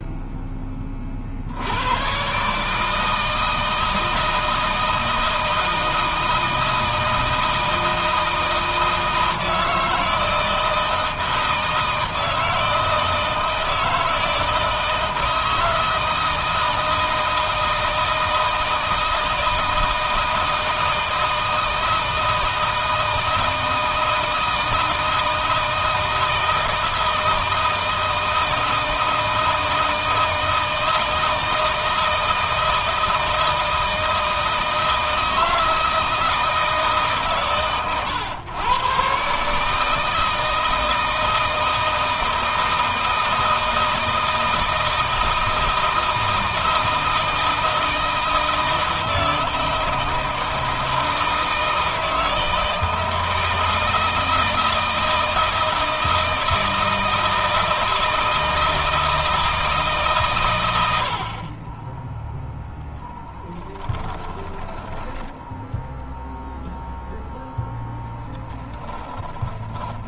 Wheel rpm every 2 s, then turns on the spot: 10, 140, 160, 160, 160, 160, 160, 160, 160, 160, 160, 160, 160, 160, 160, 160, 160, 160, 160, 120, 160, 160, 160, 160, 160, 160, 160, 160, 160, 160, 100, 10, 20, 0, 20.
62-66 68-70